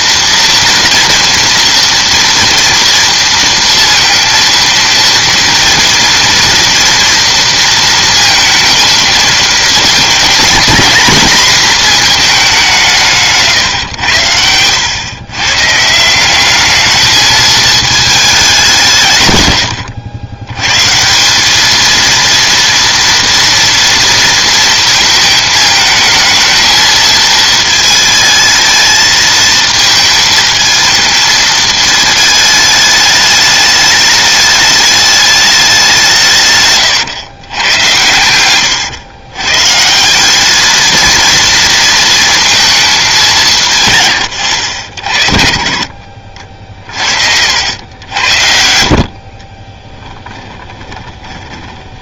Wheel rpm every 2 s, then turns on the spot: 230, 230, 230, 240, 220, 230, 200, 100, 200, 200, 120, 230, 230, 220, 220, 220, 210, 210, 150, 110, 210, 220, 80, 40, 70, 20.
38-40 50-52